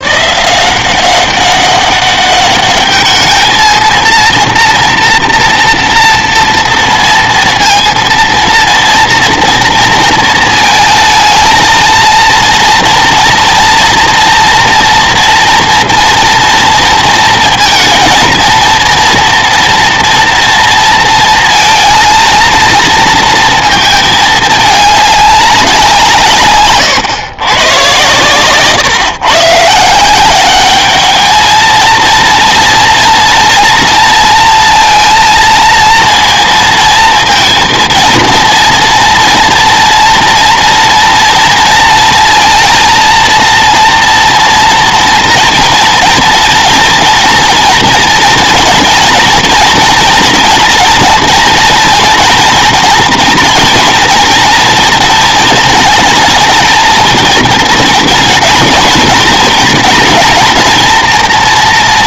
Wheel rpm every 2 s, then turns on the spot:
170, 210, 240, 230, 230, 230, 230, 230, 230, 230, 230, 230, 210, 130, 120, 200, 230, 230, 230, 240, 240, 230, 230, 230, 230, 230, 230, 230, 220, 240, 240.
26-28